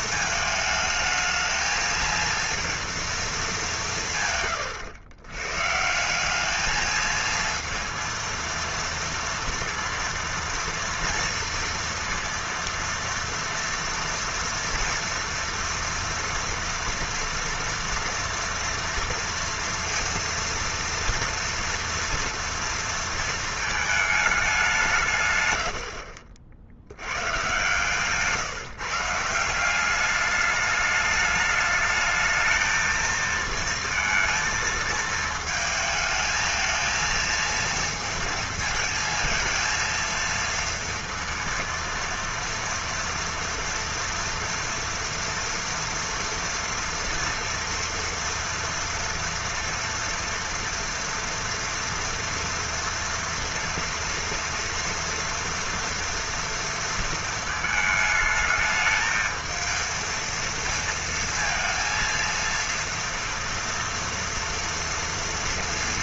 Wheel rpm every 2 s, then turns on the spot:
220, 230, 120, 210, 230, 230, 230, 230, 230, 230, 230, 230, 190, 60, 150, 210, 220, 230, 220, 230, 230, 230, 230, 230, 230, 230, 230, 230, 230, 220, 230, 230, 240.
none